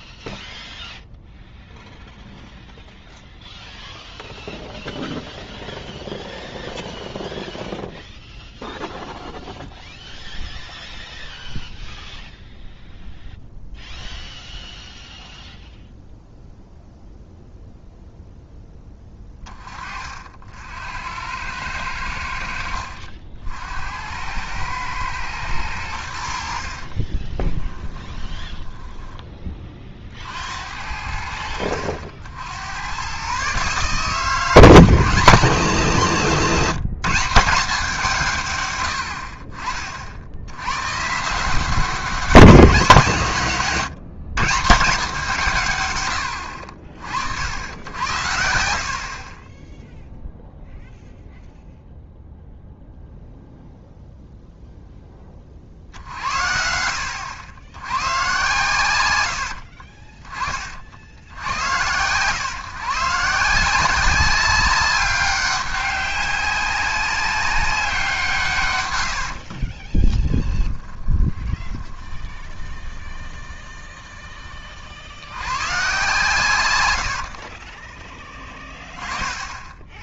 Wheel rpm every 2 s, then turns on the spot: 0, 0, 0, 0, 0, 0, 0, 0, 0, 10, 70, 70, 110, 60, 10, 70, 90, 150, 170, 120, 100, 190, 170, 70, 90, 0, 0, 0, 70, 120, 40, 130, 190, 200, 130, 20, 20, 40, 120, 20.
28-30 48-50 70-74